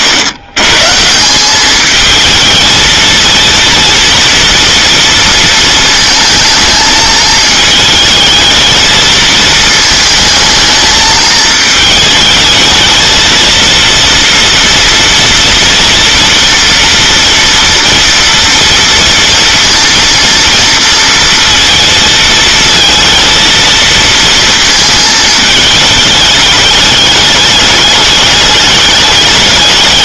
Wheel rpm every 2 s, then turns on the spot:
130, 220, 230, 220, 220, 220, 220, 230, 240, 240, 230, 230, 220, 210, 210.
none